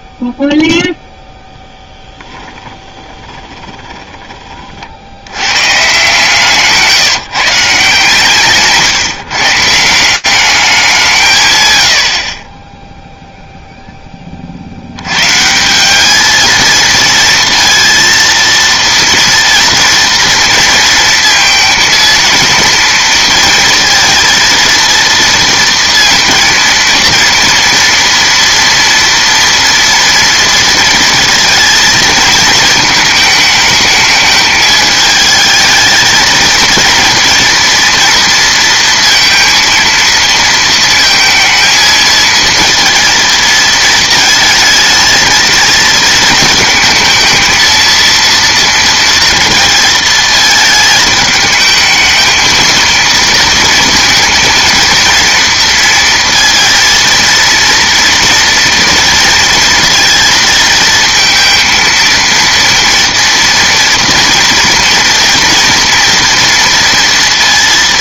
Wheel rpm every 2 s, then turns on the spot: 0, 20, 40, 160, 140, 190, 10, 70, 220, 230, 230, 230, 230, 230, 230, 230, 220, 220, 230, 230, 230, 230, 220, 220, 230, 220, 220, 230, 230, 240, 230, 230, 240, 230.
2-4